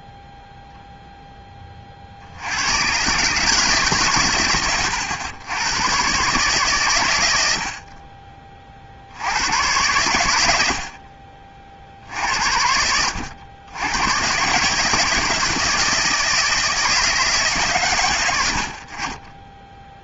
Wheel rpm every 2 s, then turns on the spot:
0, 80, 130, 140, 40, 80, 60, 140, 160, 70.
none